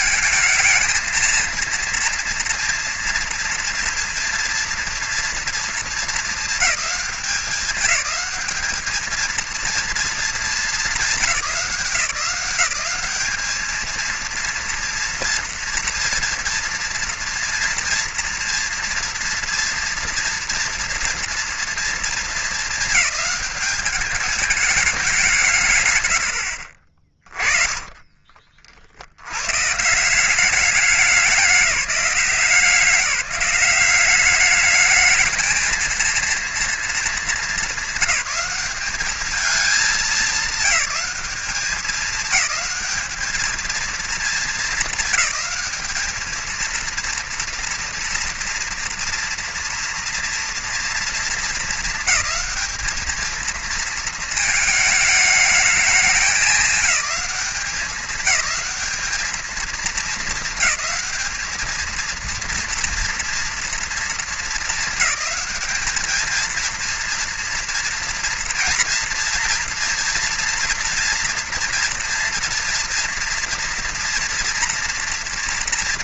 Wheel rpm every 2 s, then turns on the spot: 230, 240, 230, 200, 220, 200, 200, 230, 230, 230, 230, 210, 200, 40, 80, 200, 190, 220, 220, 210, 210, 210, 210, 230, 230, 220, 220, 220, 210, 220, 210, 230, 210, 230, 230, 230, 240, 230.
26-28